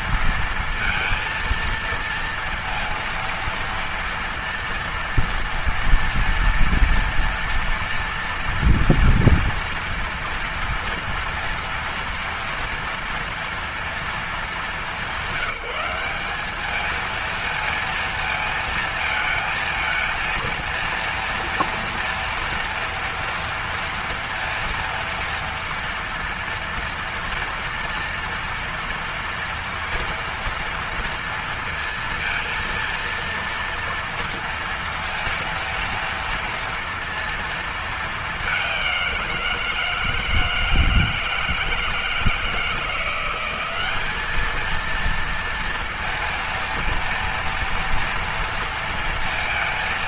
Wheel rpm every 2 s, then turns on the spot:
230, 230, 230, 230, 230, 230, 230, 210, 190, 230, 220, 230, 230, 230, 230, 230, 230, 230, 230, 210, 160, 160, 200, 230, 230.
none